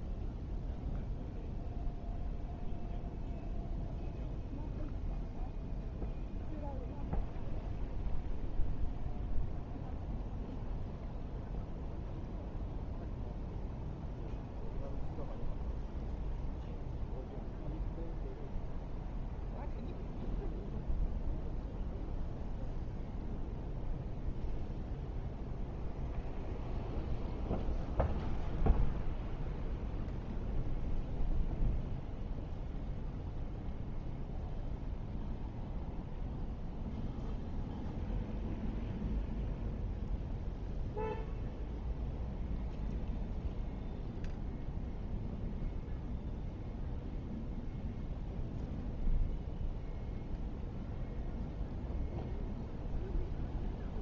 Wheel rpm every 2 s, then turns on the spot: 0, 0, 0, 0, 0, 0, 0, 0, 0, 0, 0, 0, 0, 0, 0, 0, 0, 0, 0, 0, 0, 0, 0, 0, 0, 0, 0.
none